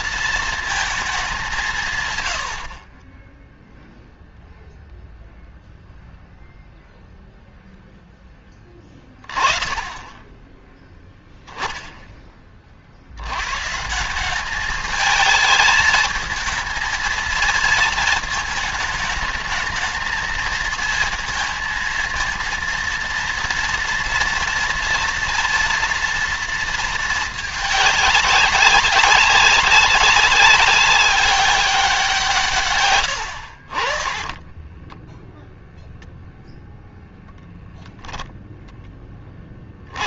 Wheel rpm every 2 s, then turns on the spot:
230, 80, 0, 0, 10, 10, 30, 190, 220, 220, 220, 230, 230, 230, 200, 190, 150, 20, 0, 0.
32-36